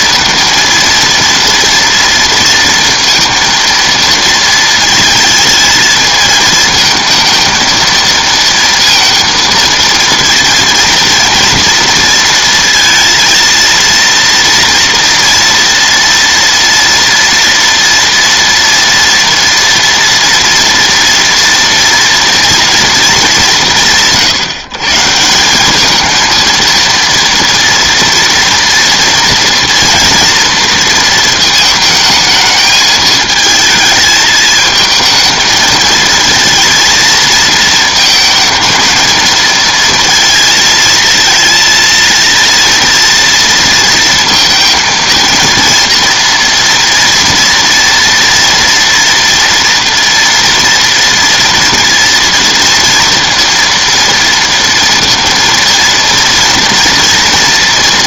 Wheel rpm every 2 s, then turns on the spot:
230, 230, 220, 220, 230, 230, 230, 230, 230, 240, 240, 230, 140, 230, 230, 230, 220, 220, 230, 230, 220, 230, 230, 230, 230, 230, 230, 230, 240.
none